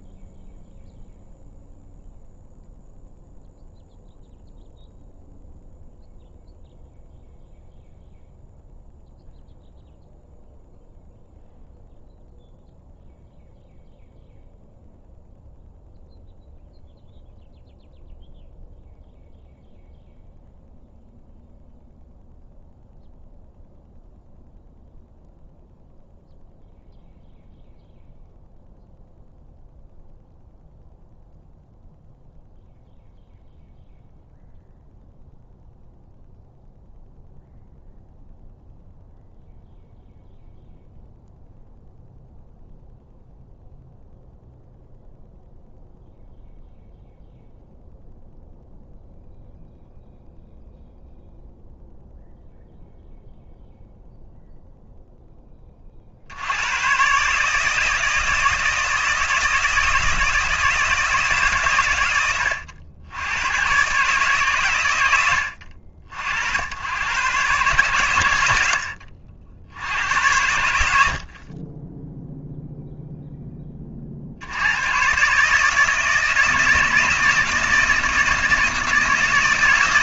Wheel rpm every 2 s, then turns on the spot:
0, 0, 0, 0, 0, 0, 0, 0, 0, 0, 0, 0, 0, 0, 0, 0, 0, 0, 0, 0, 0, 0, 0, 0, 0, 0, 0, 0, 120, 160, 160, 90, 120, 90, 80, 90, 0, 110, 160, 160.
none